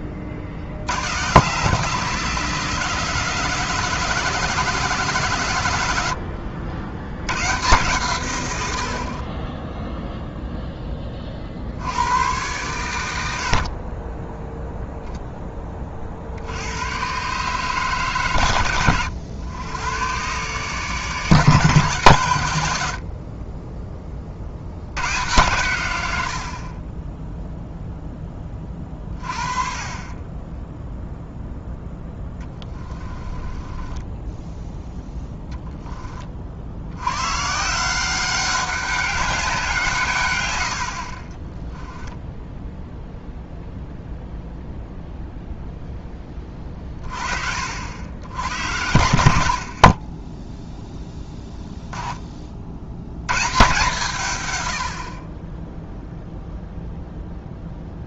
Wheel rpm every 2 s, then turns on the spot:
50, 170, 170, 90, 70, 10, 110, 0, 90, 100, 140, 90, 80, 40, 30, 10, 20, 0, 70, 200, 90, 0, 0, 30, 80, 0, 60, 90, 0.
32-34 40-42